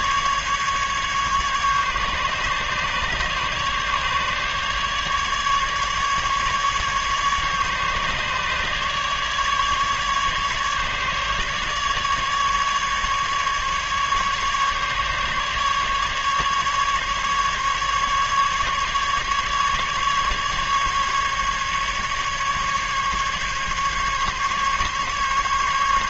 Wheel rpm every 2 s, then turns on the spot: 150, 140, 150, 140, 150, 150, 150, 150, 150, 150, 150, 150, 140.
none